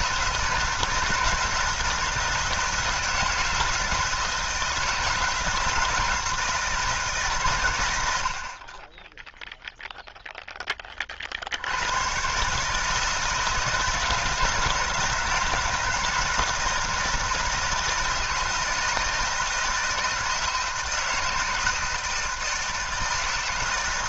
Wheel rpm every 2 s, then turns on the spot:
160, 170, 160, 160, 30, 20, 150, 160, 160, 160, 170, 160.
none